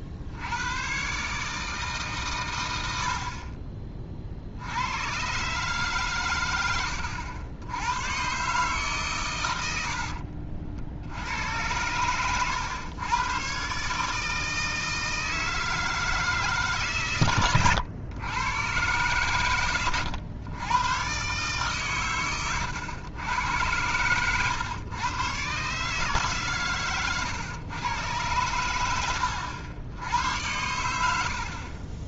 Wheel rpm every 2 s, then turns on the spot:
100, 100, 80, 100, 140, 70, 110, 160, 150, 110, 110, 100, 120, 130, 100, 100.
none